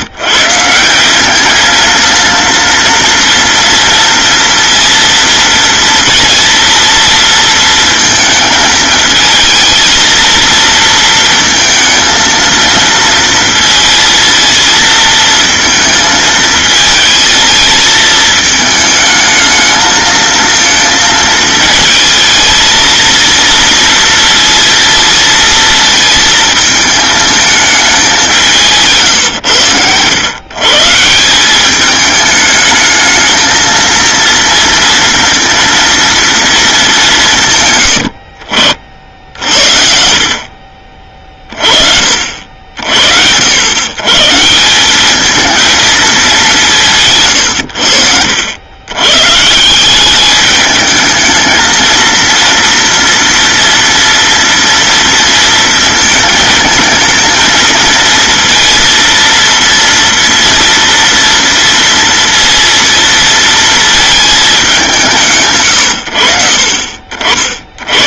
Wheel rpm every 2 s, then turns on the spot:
170, 230, 230, 230, 220, 230, 230, 230, 220, 220, 220, 220, 230, 220, 170, 140, 210, 230, 230, 60, 50, 70, 170, 180, 90, 210, 230, 230, 220, 230, 230, 230, 200, 70.
none